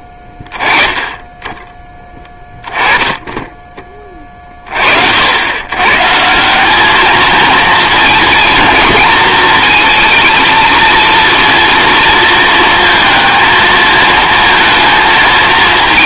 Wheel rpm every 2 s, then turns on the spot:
10, 10, 40, 190, 220, 230, 230, 230.
none